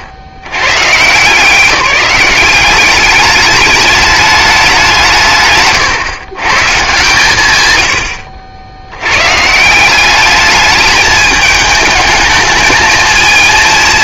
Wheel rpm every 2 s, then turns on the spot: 70, 200, 190, 140, 80, 210, 220.
none